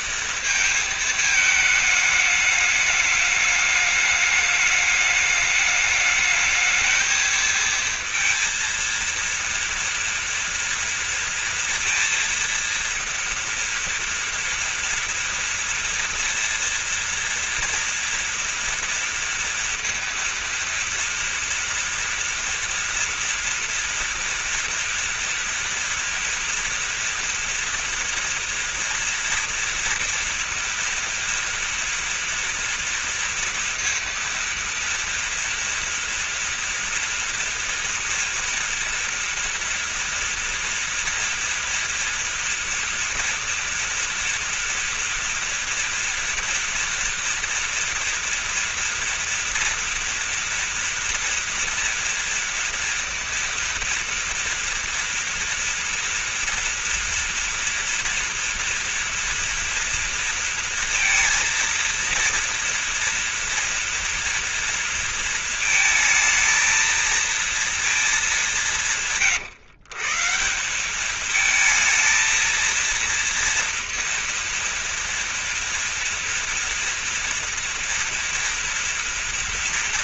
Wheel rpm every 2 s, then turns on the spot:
220, 210, 210, 220, 230, 230, 230, 230, 230, 230, 230, 240, 230, 230, 240, 230, 230, 230, 230, 230, 230, 230, 230, 230, 240, 230, 230, 230, 240, 240, 230, 230, 230, 230, 180, 190, 230, 230, 230, 230.
none